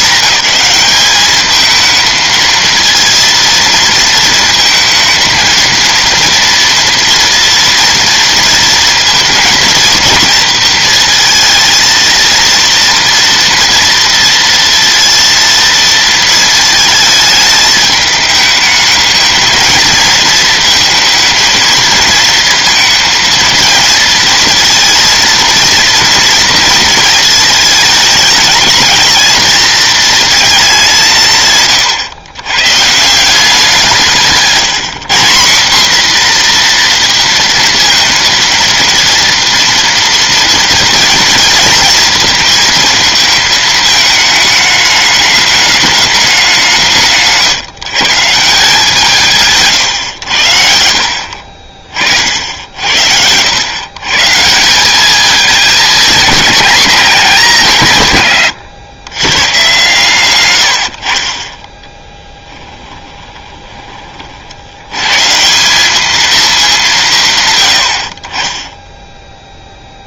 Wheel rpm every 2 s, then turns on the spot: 200, 230, 220, 230, 230, 230, 230, 230, 230, 220, 220, 230, 230, 230, 220, 220, 120, 180, 240, 230, 230, 230, 210, 190, 160, 70, 70, 170, 210, 120, 90, 10, 60, 210, 20.
62-64